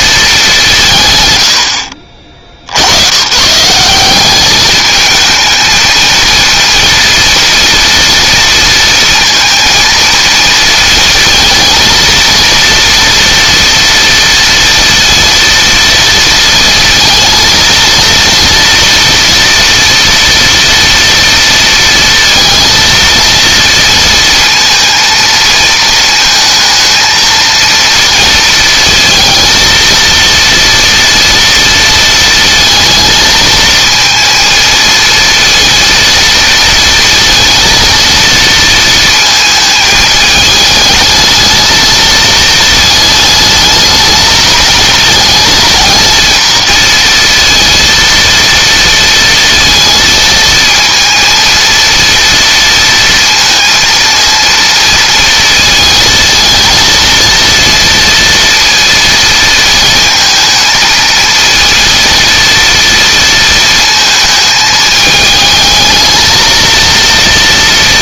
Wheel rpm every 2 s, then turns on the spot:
190, 70, 210, 230, 230, 230, 230, 230, 230, 230, 240, 230, 230, 220, 230, 230, 230, 230, 230, 230, 210, 220, 220, 230, 230, 220, 230, 230, 220, 230, 220, 230, 220, 220.
none